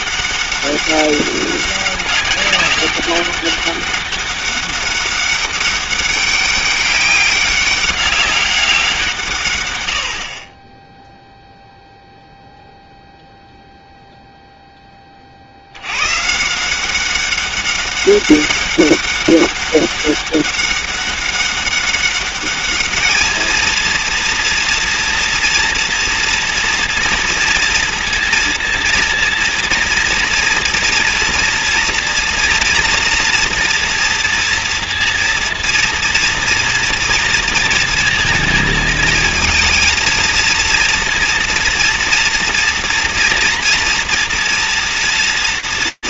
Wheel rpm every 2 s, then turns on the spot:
200, 200, 200, 200, 190, 20, 0, 0, 170, 200, 200, 210, 230, 230, 230, 230, 240, 230, 230, 220, 230, 230, 230.
none